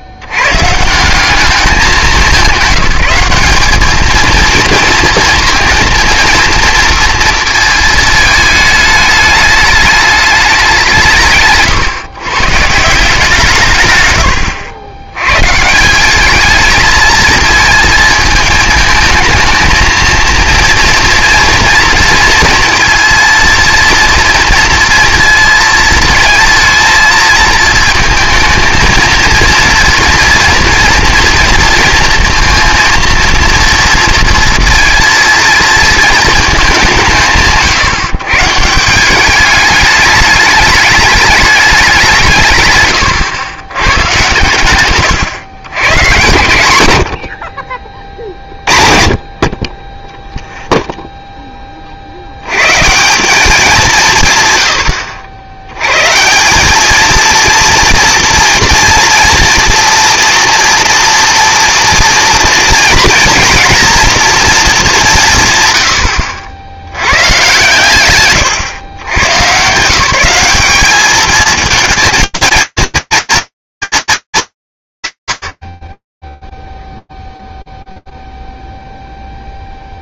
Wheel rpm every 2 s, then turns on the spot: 110, 190, 230, 230, 220, 190, 150, 80, 220, 220, 230, 230, 230, 230, 220, 230, 230, 230, 170, 150, 210, 130, 120, 120, 40, 0, 120, 130, 200, 230, 230, 230, 220, 90, 100, 200, 230, 190, 0, 0.
none